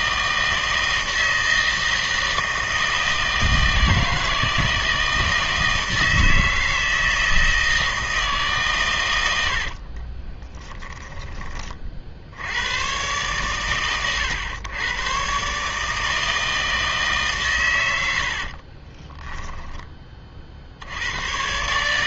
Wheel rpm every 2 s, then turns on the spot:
160, 160, 160, 160, 140, 20, 100, 110, 160, 40, 70.
10-12 18-20